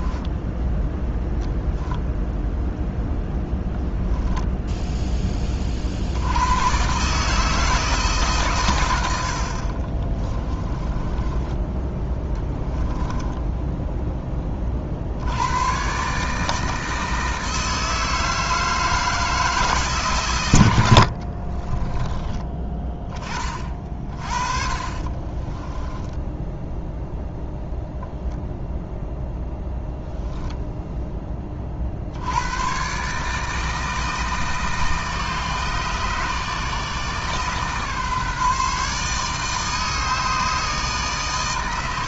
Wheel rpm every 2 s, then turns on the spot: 0, 0, 10, 130, 100, 20, 10, 60, 160, 160, 80, 20, 30, 0, 0, 10, 130, 150, 150, 150, 150.
10-14 20-22 24-26